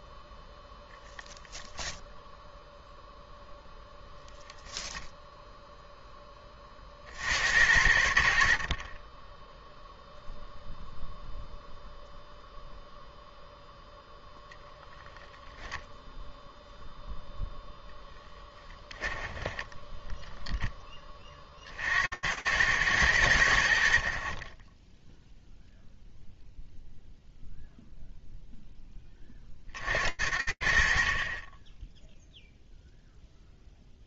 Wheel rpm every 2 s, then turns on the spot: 0, 0, 0, 50, 40, 0, 0, 0, 0, 10, 10, 110, 20, 0, 10, 30, 0.
8-10 18-20